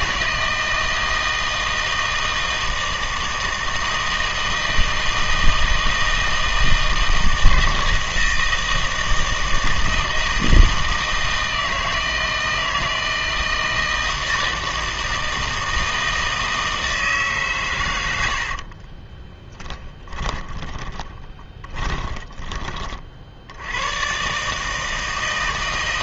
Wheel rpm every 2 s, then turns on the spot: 160, 160, 160, 160, 160, 160, 160, 160, 160, 40, 20, 30, 150.
18-22